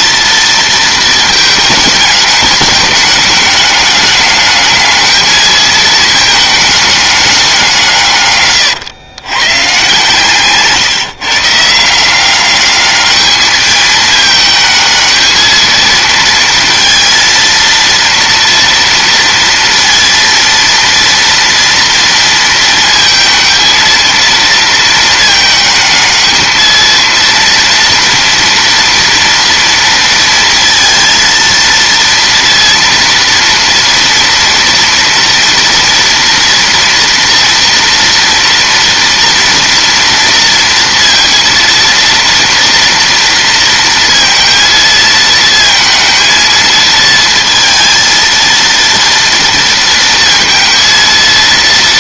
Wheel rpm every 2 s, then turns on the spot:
230, 210, 210, 210, 120, 150, 200, 220, 230, 230, 230, 230, 220, 220, 240, 230, 230, 230, 230, 230, 230, 230, 230, 220, 230, 230.
none